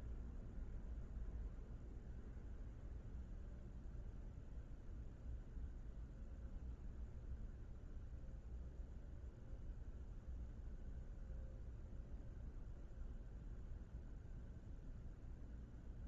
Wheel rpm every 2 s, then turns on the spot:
0, 0, 0, 0, 0, 0, 0, 0.
none